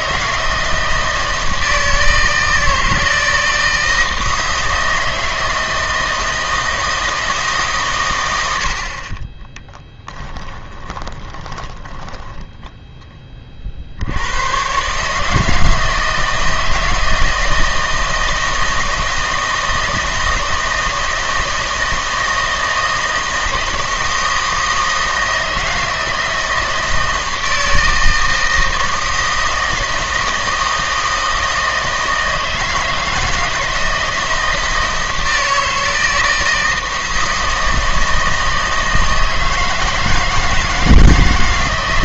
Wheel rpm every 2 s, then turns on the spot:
160, 160, 160, 160, 70, 20, 10, 120, 160, 160, 160, 160, 160, 160, 160, 160, 160, 160, 160, 160, 160.
10-14